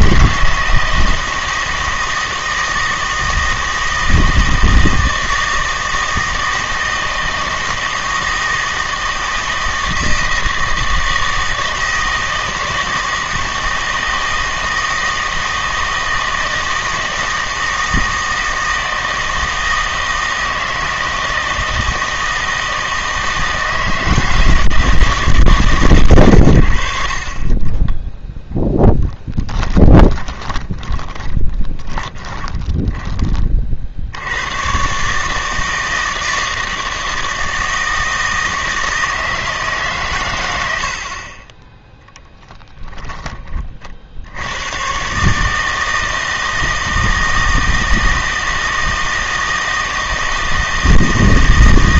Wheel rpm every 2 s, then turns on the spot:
160, 160, 160, 160, 160, 160, 160, 160, 160, 160, 160, 160, 160, 80, 0, 20, 20, 110, 160, 160, 80, 10, 110, 160, 160, 160.
30-34